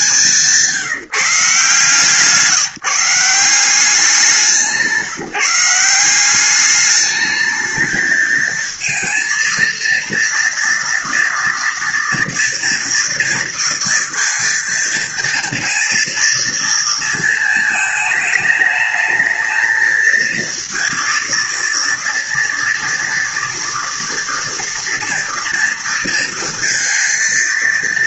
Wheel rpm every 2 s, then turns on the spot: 160, 160, 180, 210, 220, 230, 230, 230, 230, 220, 230, 230, 230, 230.
none